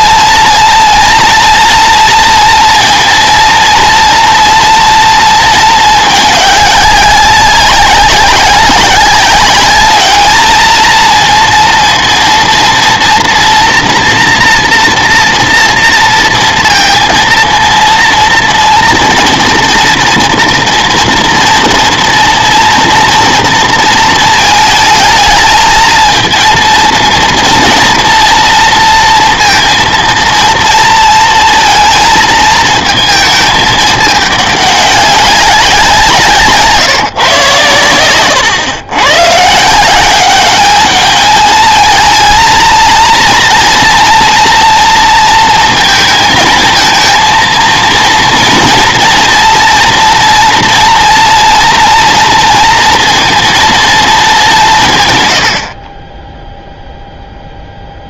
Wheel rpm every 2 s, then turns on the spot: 230, 230, 230, 200, 200, 220, 230, 230, 230, 230, 230, 230, 220, 230, 230, 230, 230, 200, 150, 110, 210, 230, 230, 220, 230, 230, 230, 180, 0.
none